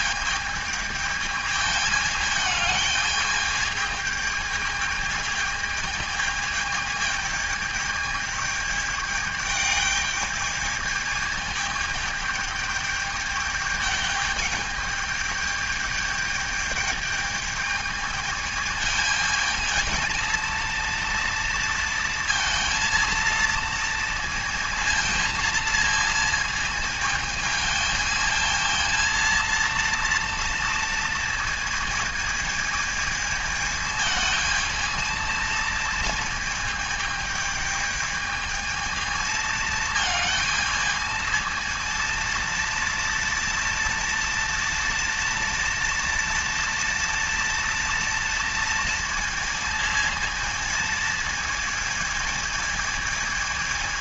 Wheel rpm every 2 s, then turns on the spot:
220, 210, 220, 220, 210, 220, 210, 210, 210, 220, 230, 230, 220, 220, 230, 230, 220, 220, 220, 220, 220, 230, 230, 230, 230, 220, 220.
none